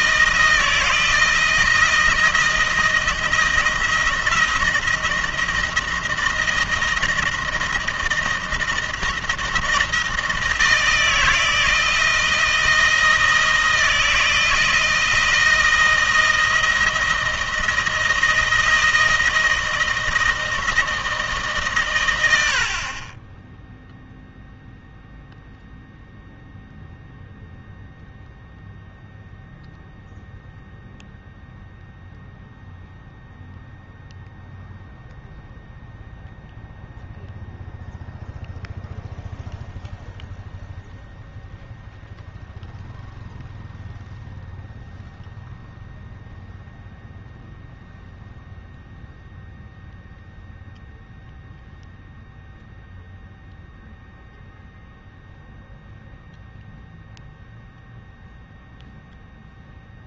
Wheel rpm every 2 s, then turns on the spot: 160, 170, 170, 170, 160, 160, 160, 160, 160, 160, 160, 70, 0, 0, 0, 0, 0, 0, 0, 0, 0, 0, 0, 0, 0, 0, 0, 0, 0, 0.
none